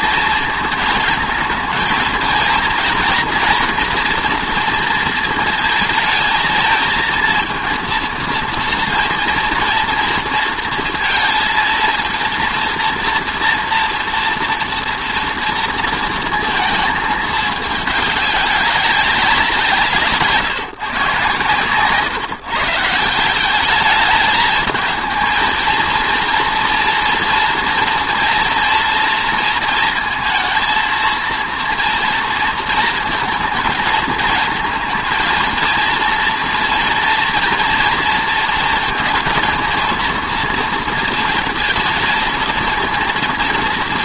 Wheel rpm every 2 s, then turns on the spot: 220, 230, 230, 220, 230, 230, 240, 230, 220, 200, 150, 150, 220, 230, 230, 230, 230, 220, 240, 230, 230, 220.
none